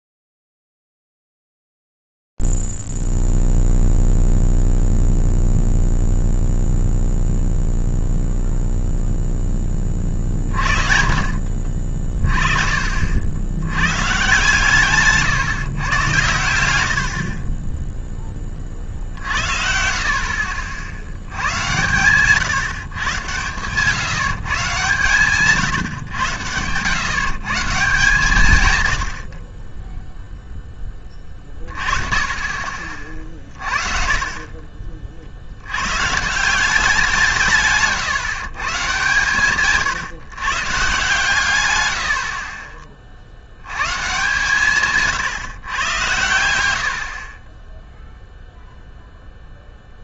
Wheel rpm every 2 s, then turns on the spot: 0, 0, 0, 0, 0, 30, 30, 120, 120, 20, 50, 130, 150, 110, 140, 10, 40, 30, 180, 150, 140, 40, 140, 80, 0.
none